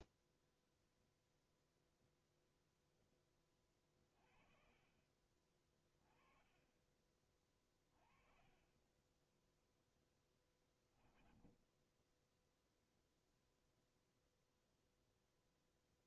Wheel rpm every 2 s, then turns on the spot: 0, 0, 30, 30, 30, 20, 0, 0.
10-12